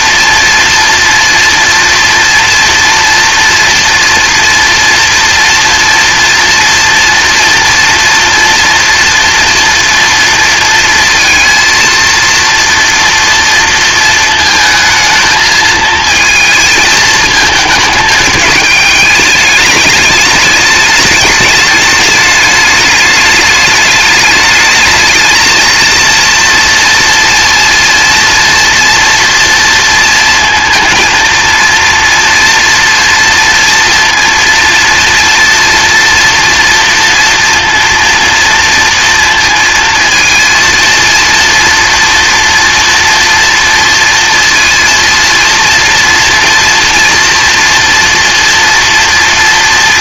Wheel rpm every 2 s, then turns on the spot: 230, 230, 230, 230, 240, 230, 230, 220, 220, 210, 210, 210, 220, 230, 230, 230, 230, 230, 240, 230, 230, 230, 230, 230, 240.
none